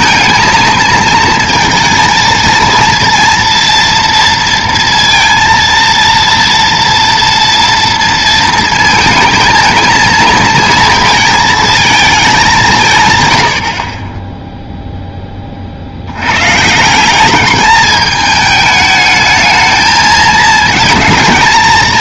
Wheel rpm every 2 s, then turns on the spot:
220, 230, 230, 230, 230, 230, 190, 0, 140, 210, 210.
none